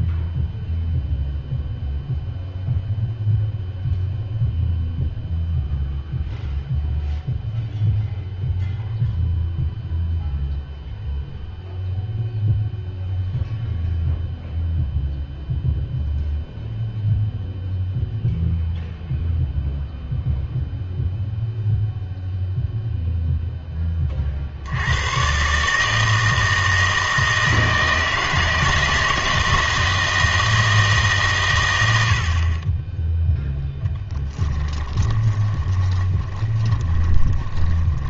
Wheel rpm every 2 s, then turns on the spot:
0, 0, 0, 0, 0, 0, 0, 0, 0, 0, 0, 0, 80, 160, 160, 160, 30, 20, 20.
34-38